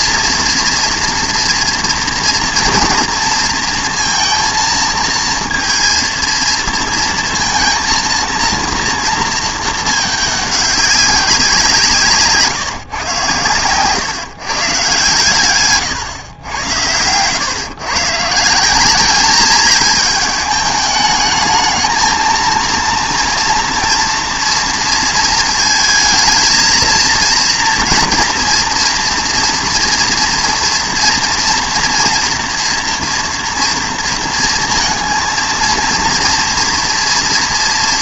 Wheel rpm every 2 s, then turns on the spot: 230, 230, 230, 230, 230, 200, 140, 140, 90, 190, 210, 230, 230, 220, 230, 230, 230, 230, 230.
none